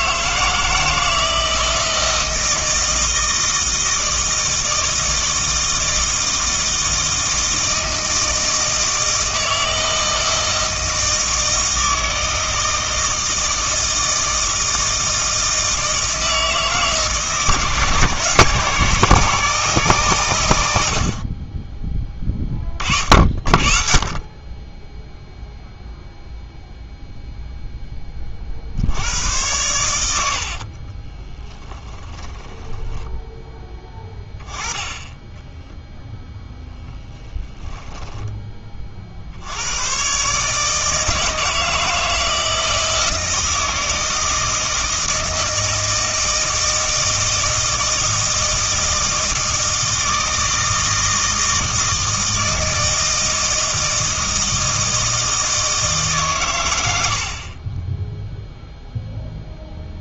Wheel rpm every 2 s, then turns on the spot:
160, 160, 160, 160, 160, 160, 160, 160, 150, 150, 70, 30, 10, 0, 80, 30, 10, 10, 0, 30, 150, 160, 160, 160, 160, 160, 160, 160, 90, 0.
30-34